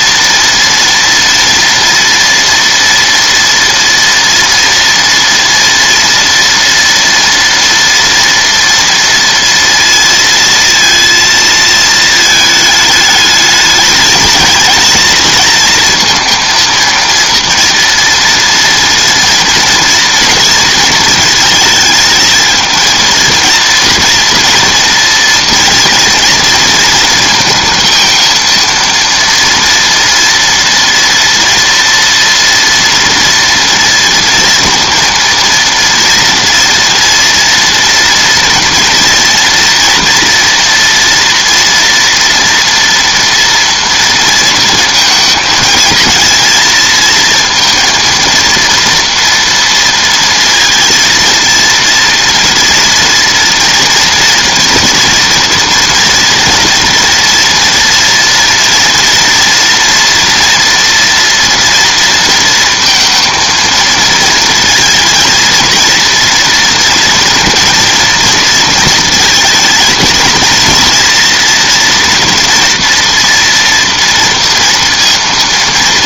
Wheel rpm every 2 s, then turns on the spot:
230, 230, 230, 230, 230, 230, 210, 230, 230, 230, 230, 230, 230, 230, 230, 240, 230, 230, 240, 240, 230, 230, 230, 220, 230, 230, 230, 230, 230, 230, 230, 230, 230, 230, 230, 230, 230, 230.
none